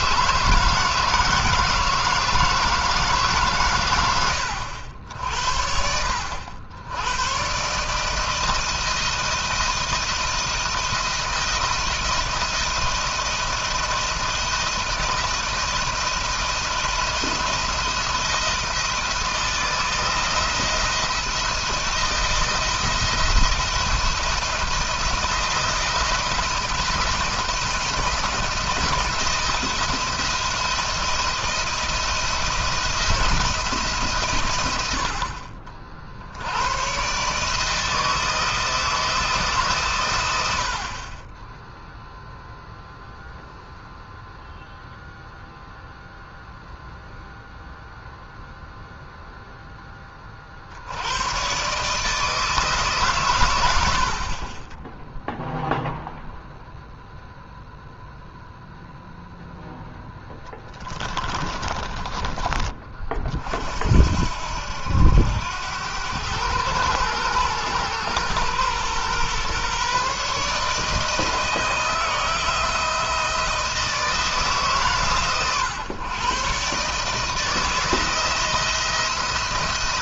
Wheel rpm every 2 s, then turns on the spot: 160, 150, 70, 100, 160, 160, 160, 160, 170, 160, 160, 170, 170, 160, 160, 170, 160, 70, 120, 170, 50, 0, 0, 0, 0, 70, 150, 20, 0, 0, 10, 30, 80, 110, 120, 160, 160, 140, 140, 170.
60-62